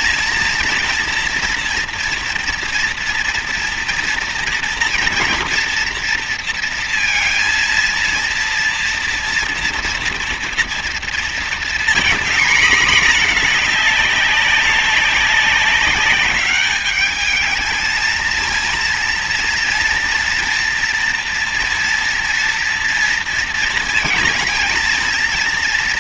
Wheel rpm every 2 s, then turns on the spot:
230, 230, 240, 230, 230, 230, 240, 200, 210, 230, 230, 230, 230.
none